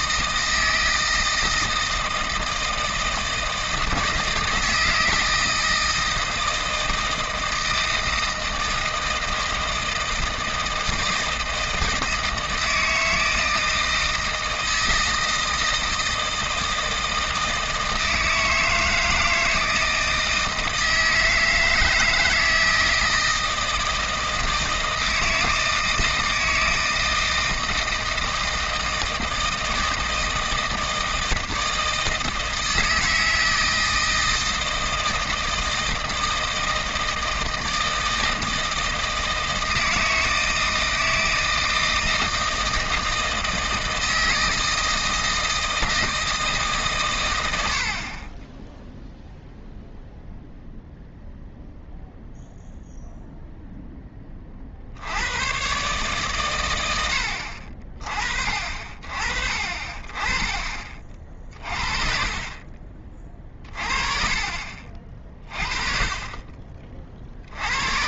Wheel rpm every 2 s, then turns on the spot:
160, 160, 160, 160, 160, 160, 160, 160, 160, 160, 160, 160, 160, 160, 160, 160, 160, 160, 160, 160, 160, 160, 160, 150, 10, 0, 0, 40, 110, 40, 40, 30, 40, 30.
60-62